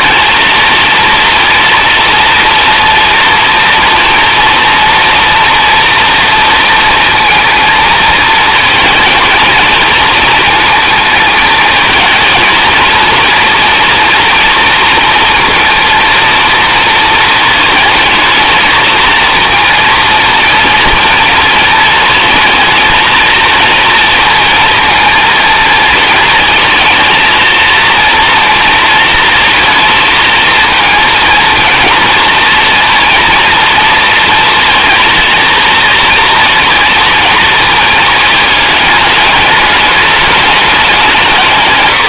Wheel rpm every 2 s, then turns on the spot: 230, 230, 230, 230, 220, 220, 230, 230, 230, 220, 230, 220, 220, 230, 230, 230, 230, 230, 230, 210, 200.
none